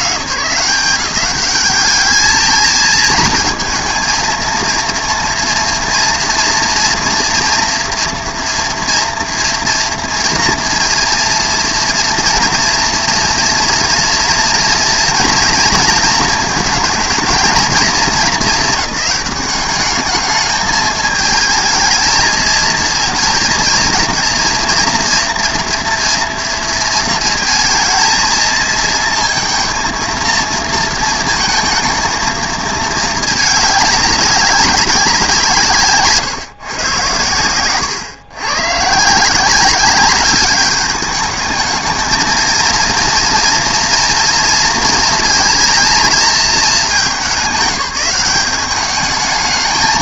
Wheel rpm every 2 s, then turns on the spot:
180, 220, 230, 230, 230, 230, 230, 230, 220, 200, 210, 220, 230, 230, 220, 230, 220, 190, 130, 130, 200, 230, 230, 210, 190.
none